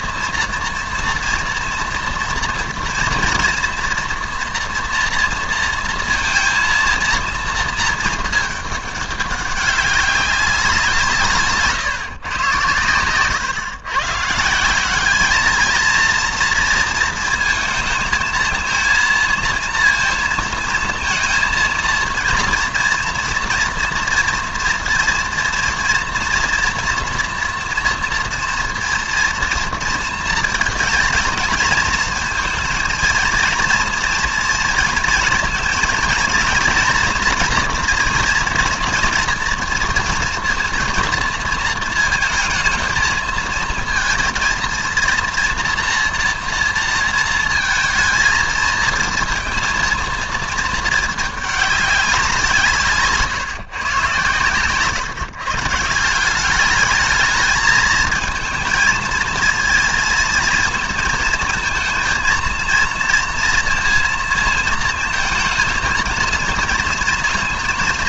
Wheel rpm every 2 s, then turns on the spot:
230, 230, 230, 230, 210, 180, 110, 170, 230, 230, 230, 230, 230, 230, 230, 220, 220, 230, 240, 230, 230, 220, 230, 230, 220, 220, 170, 120, 200, 220, 220, 230, 230, 230.
54-56